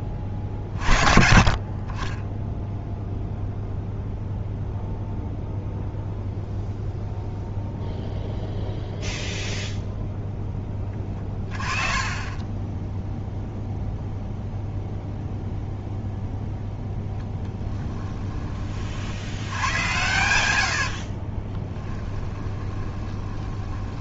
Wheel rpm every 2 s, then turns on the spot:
50, 0, 0, 0, 0, 20, 0, 0, 0, 60, 60, 20.
0-2 10-12 20-24